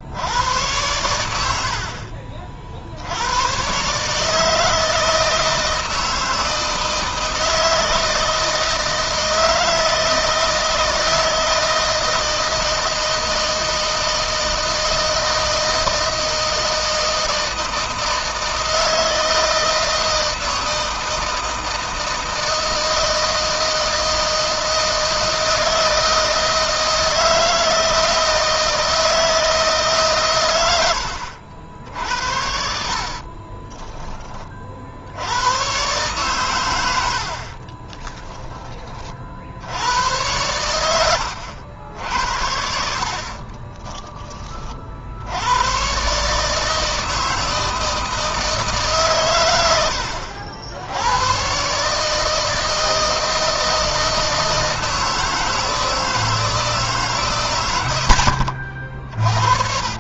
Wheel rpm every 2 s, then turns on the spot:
100, 80, 160, 160, 160, 160, 160, 160, 160, 160, 160, 160, 160, 160, 160, 90, 40, 60, 100, 30, 90, 60, 50, 160, 140, 90, 160, 160, 140, 50.
32-34